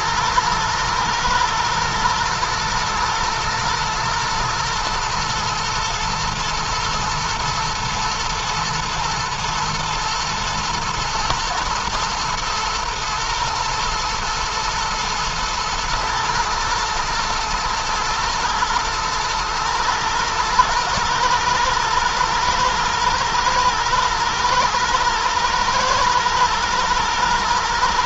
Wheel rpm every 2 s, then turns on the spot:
120, 120, 110, 110, 120, 110, 110, 110, 110, 110, 110, 110, 120, 120.
none